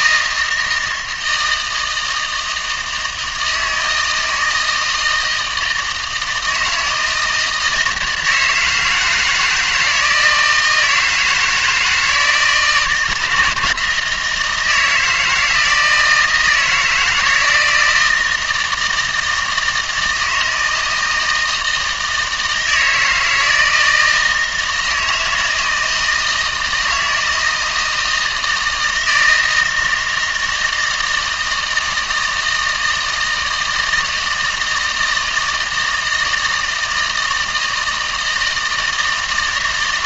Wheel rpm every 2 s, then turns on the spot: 160, 160, 160, 160, 160, 160, 160, 170, 170, 160, 160, 160, 160, 160, 160, 160, 160, 160, 160, 160.
none